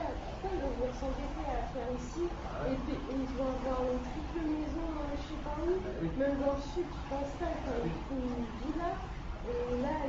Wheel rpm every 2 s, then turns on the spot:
0, 0, 0, 0, 0.
none